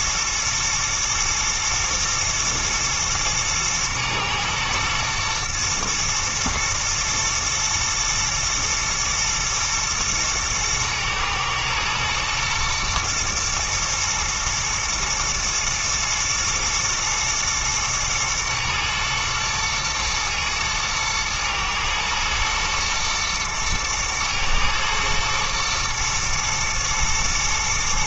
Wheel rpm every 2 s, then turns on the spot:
110, 110, 110, 110, 110, 110, 120, 110, 110, 110, 110, 120, 110, 110.
none